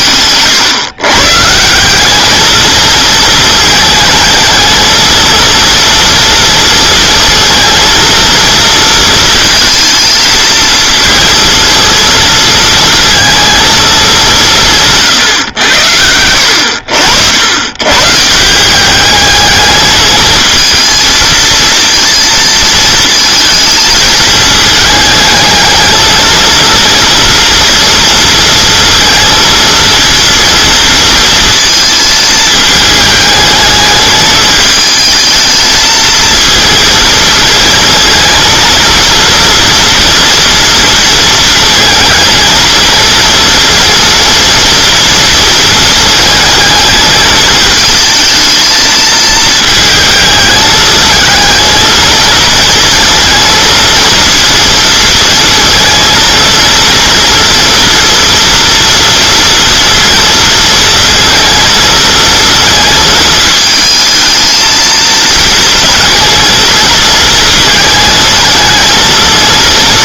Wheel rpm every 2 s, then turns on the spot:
130, 220, 220, 230, 230, 230, 230, 160, 80, 190, 220, 220, 220, 230, 230, 230, 220, 220, 220, 230, 230, 230, 230, 220, 220, 220, 230, 230, 230, 230, 220, 220, 230, 230, 220.
none